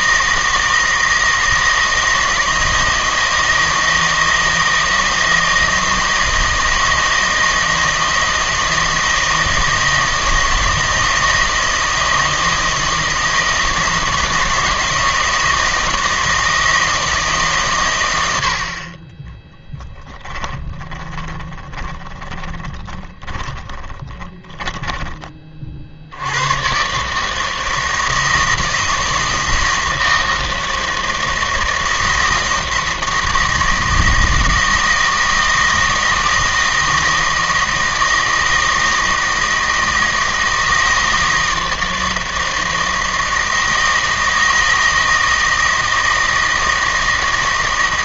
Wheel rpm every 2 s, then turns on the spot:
160, 160, 160, 160, 160, 160, 160, 160, 160, 50, 20, 30, 20, 120, 160, 160, 160, 160, 160, 160, 160, 160, 160, 160.
20-26